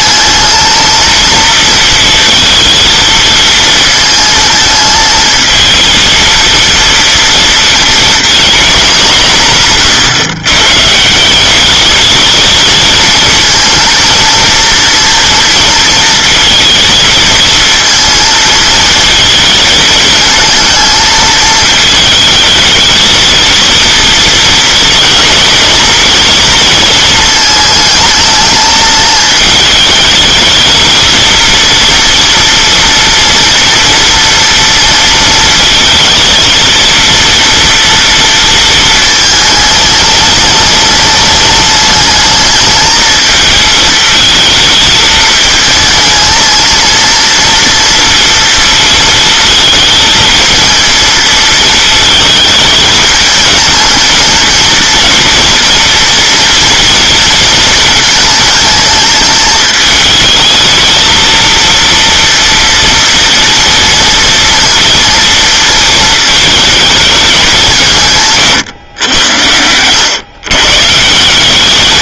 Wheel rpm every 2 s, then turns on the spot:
230, 220, 220, 230, 220, 130, 220, 230, 220, 220, 230, 220, 230, 230, 220, 220, 230, 230, 230, 230, 210, 220, 220, 230, 230, 230, 220, 230, 230, 220, 220, 230, 230, 220, 140, 140.
none